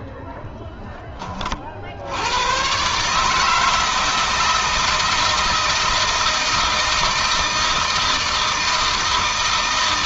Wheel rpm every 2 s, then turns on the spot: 20, 140, 160, 160, 160.
none